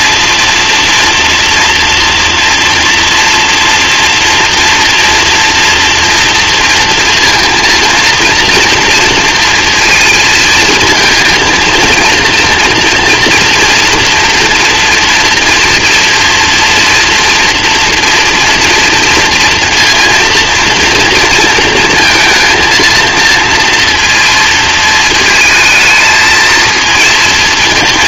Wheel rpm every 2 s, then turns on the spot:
240, 230, 230, 230, 240, 230, 230, 230, 230, 230, 230, 230, 230, 230.
none